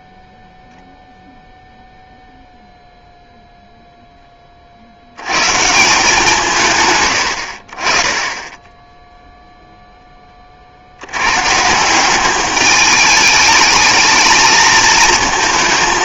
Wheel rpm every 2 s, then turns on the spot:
0, 0, 40, 130, 10, 50, 210, 230.
none